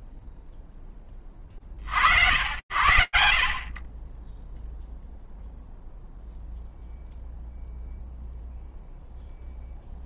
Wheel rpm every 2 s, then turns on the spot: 60, 0, 0, 0, 0.
none